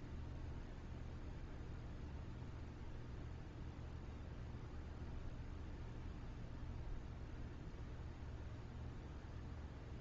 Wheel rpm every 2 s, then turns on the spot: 0, 0, 0, 0, 0.
none